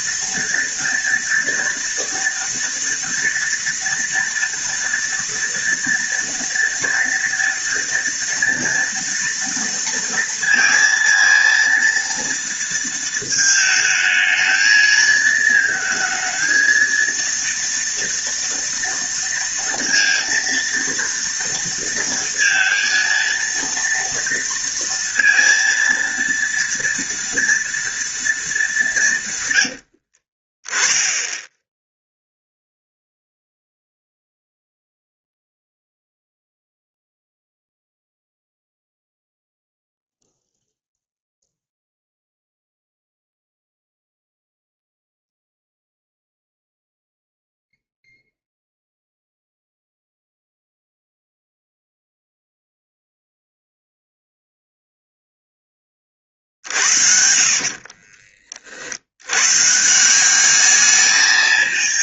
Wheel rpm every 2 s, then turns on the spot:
230, 230, 230, 230, 240, 230, 230, 220, 220, 230, 230, 230, 230, 230, 210, 30, 0, 0, 0, 0, 0, 0, 0, 0, 0, 0, 0, 0, 50, 40, 200.
30-32